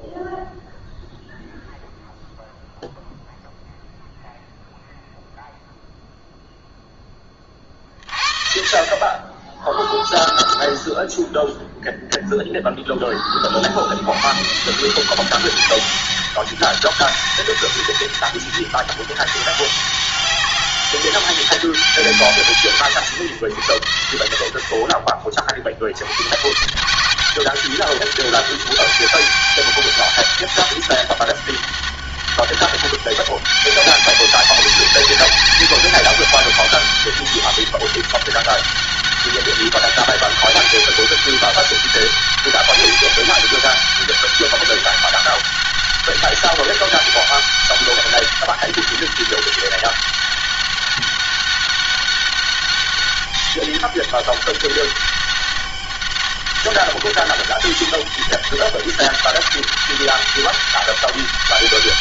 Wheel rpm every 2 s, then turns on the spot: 0, 0, 0, 0, 50, 0, 20, 130, 200, 200, 200, 150, 60, 130, 200, 200, 200, 200, 200, 200, 200, 200, 200, 190, 200, 200, 200, 200, 200, 200, 200.
none